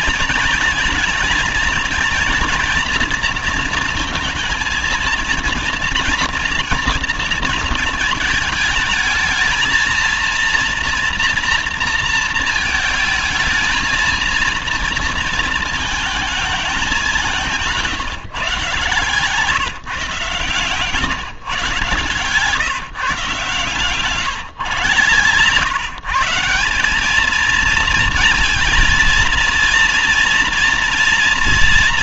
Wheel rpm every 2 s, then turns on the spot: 220, 230, 230, 230, 220, 230, 220, 230, 200, 150, 130, 150, 130, 180, 230, 230.
none